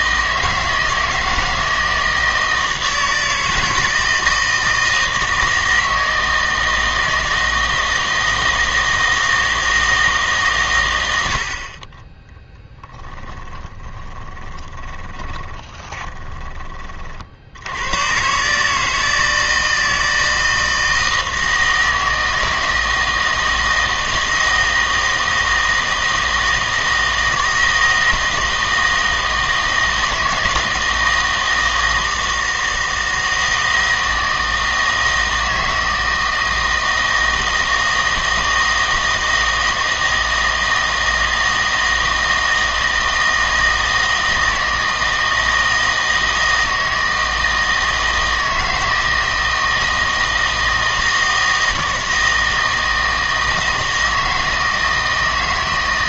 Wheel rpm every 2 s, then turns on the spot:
160, 160, 160, 160, 160, 120, 10, 20, 30, 150, 160, 160, 160, 160, 160, 160, 160, 160, 160, 160, 160, 160, 160, 160, 160, 160, 160, 160.
12-16